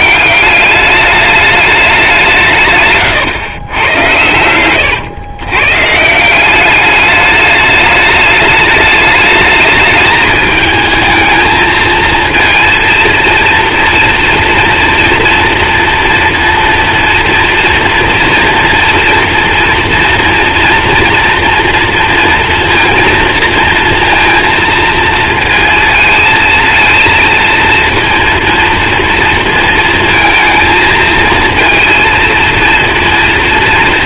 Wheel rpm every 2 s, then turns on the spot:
200, 140, 100, 190, 210, 220, 230, 230, 230, 240, 230, 230, 230, 220, 230, 220, 230.
4-6